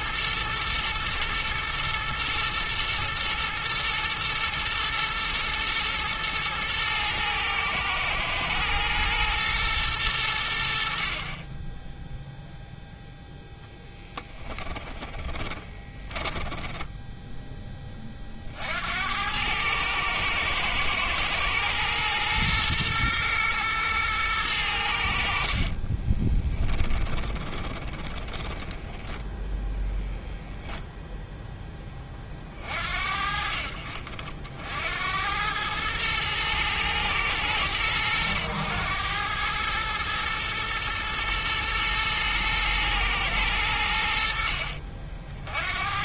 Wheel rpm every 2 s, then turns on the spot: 110, 120, 110, 110, 120, 60, 0, 10, 10, 60, 110, 120, 90, 20, 10, 0, 70, 80, 110, 100, 110, 110, 60.
14-18 26-30